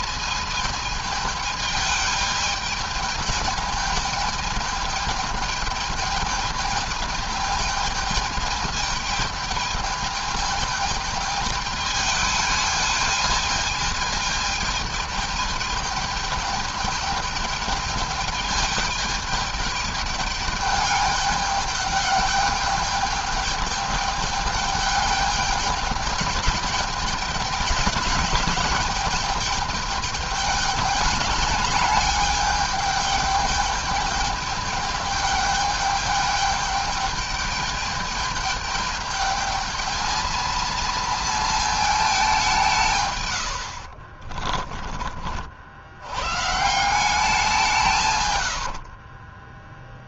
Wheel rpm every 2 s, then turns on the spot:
220, 220, 220, 210, 210, 220, 210, 220, 210, 210, 210, 210, 210, 210, 210, 210, 210, 210, 210, 210, 220, 160, 30, 170, 60.
44-46 48-50